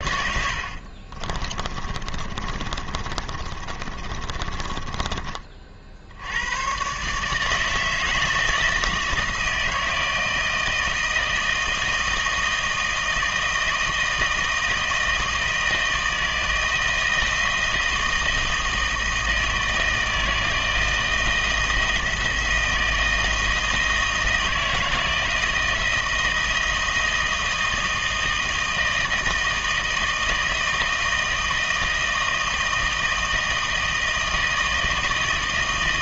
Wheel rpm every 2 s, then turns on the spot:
50, 30, 20, 120, 160, 160, 160, 160, 160, 160, 160, 160, 160, 160, 160, 160, 160, 160.
0-6